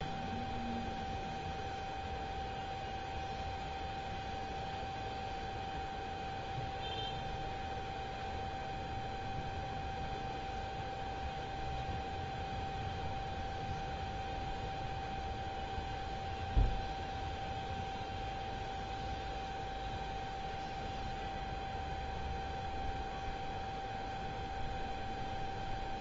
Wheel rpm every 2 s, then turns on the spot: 0, 0, 0, 0, 0, 0, 0, 0, 0, 0, 0, 0, 0.
none